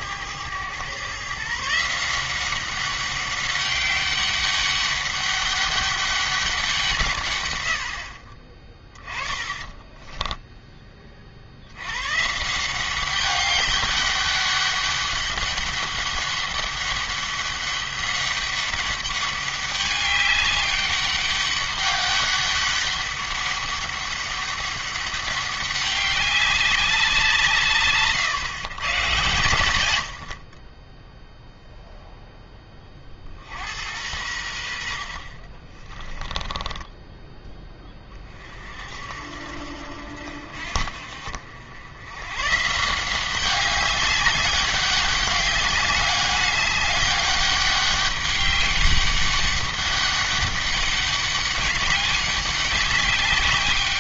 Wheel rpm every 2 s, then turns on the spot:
110, 190, 200, 170, 20, 10, 180, 200, 200, 200, 200, 200, 200, 200, 120, 20, 20, 70, 20, 50, 60, 160, 200, 200, 200, 200, 200.
8-10 36-38